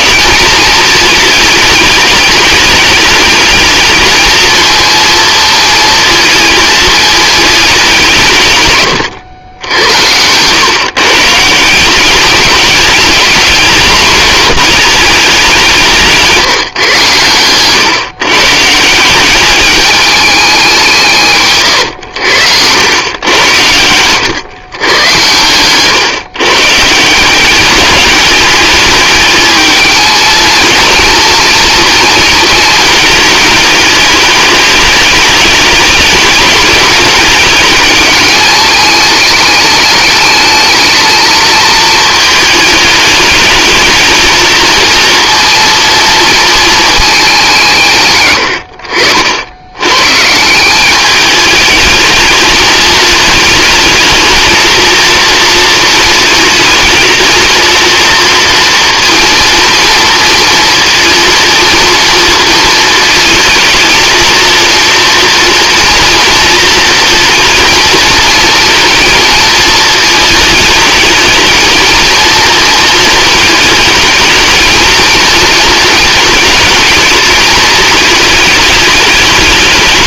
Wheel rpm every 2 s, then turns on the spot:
220, 210, 220, 220, 140, 130, 210, 230, 160, 160, 190, 90, 110, 140, 210, 230, 230, 210, 210, 210, 220, 210, 230, 220, 70, 180, 220, 230, 230, 230, 230, 230, 230, 230, 230, 220, 230, 230, 220, 210.
none